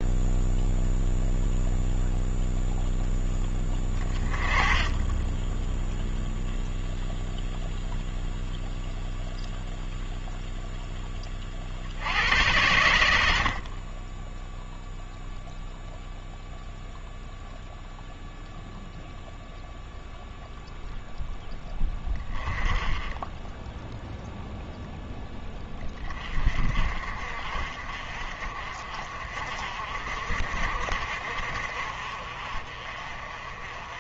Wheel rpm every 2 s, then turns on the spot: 0, 0, 20, 0, 0, 10, 90, 0, 0, 0, 0, 20, 0, 40, 40, 50, 40.
none